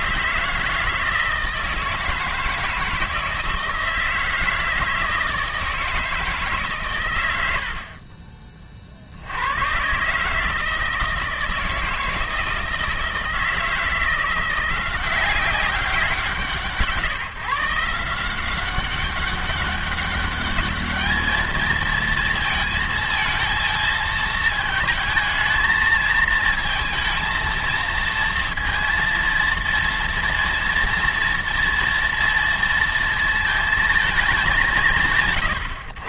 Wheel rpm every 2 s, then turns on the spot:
160, 160, 160, 140, 40, 160, 160, 180, 140, 190, 210, 230, 220, 220, 230, 230, 230, 180.
none